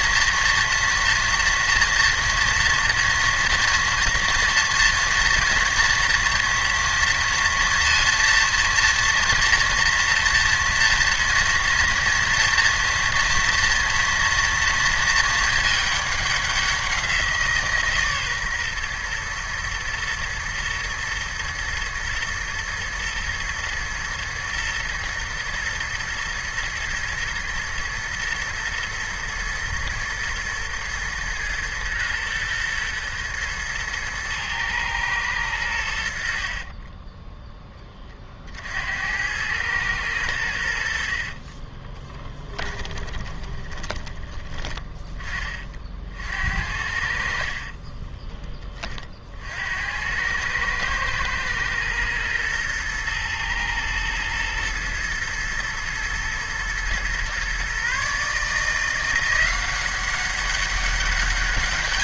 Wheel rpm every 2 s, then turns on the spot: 230, 230, 230, 230, 230, 230, 230, 230, 190, 130, 120, 110, 110, 110, 110, 110, 120, 110, 30, 60, 80, 20, 20, 60, 20, 100, 110, 120, 120, 160, 200.
36-38 42-44